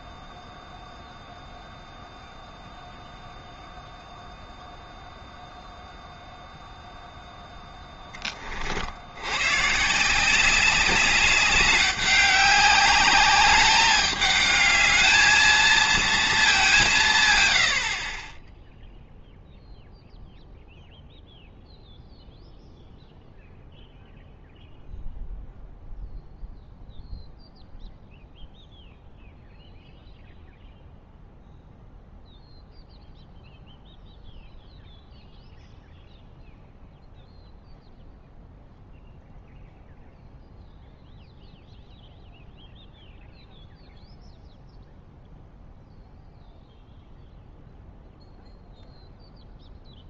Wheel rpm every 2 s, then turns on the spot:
0, 0, 0, 0, 50, 190, 200, 210, 190, 10, 0, 0, 0, 0, 0, 0, 0, 0, 0, 0, 0, 0, 0, 0, 0.
none